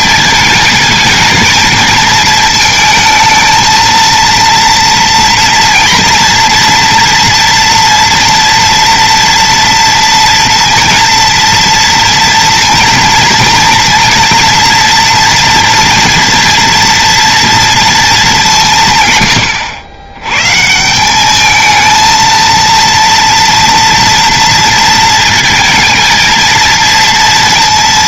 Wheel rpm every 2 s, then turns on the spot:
220, 220, 230, 240, 230, 230, 230, 230, 230, 140, 180, 230, 230, 230.
none